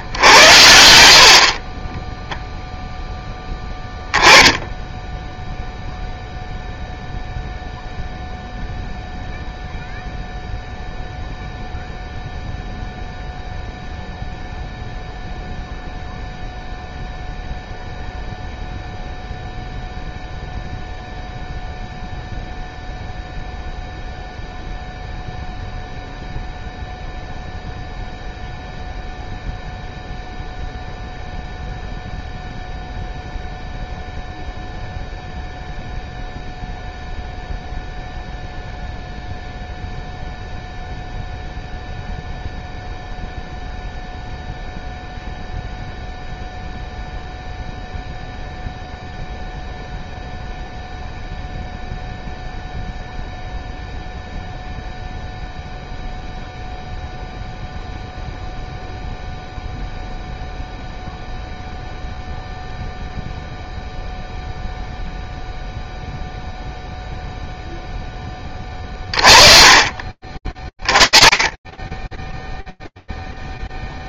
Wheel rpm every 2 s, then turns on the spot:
80, 0, 10, 0, 0, 0, 0, 0, 0, 0, 0, 0, 0, 0, 0, 0, 0, 0, 0, 0, 0, 0, 0, 0, 0, 0, 0, 0, 0, 0, 0, 0, 0, 0, 30, 30, 0.
68-70